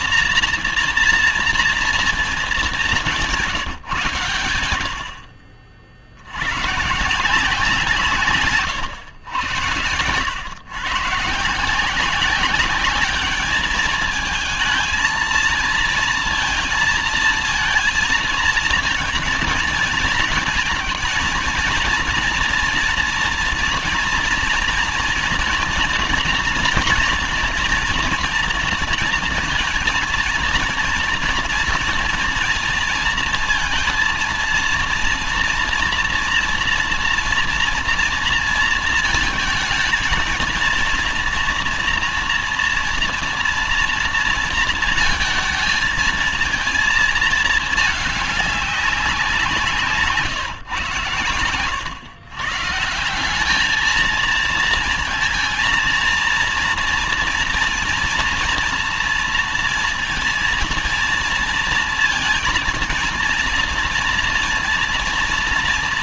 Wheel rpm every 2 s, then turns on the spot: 240, 210, 110, 90, 130, 110, 200, 220, 230, 230, 220, 230, 240, 230, 240, 230, 230, 230, 230, 230, 230, 230, 230, 230, 200, 150, 130, 220, 230, 230, 230, 230, 230.
none